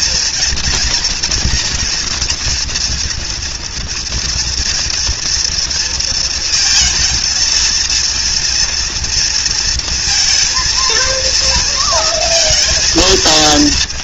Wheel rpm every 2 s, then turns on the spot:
230, 230, 230, 220, 240, 230, 230.
none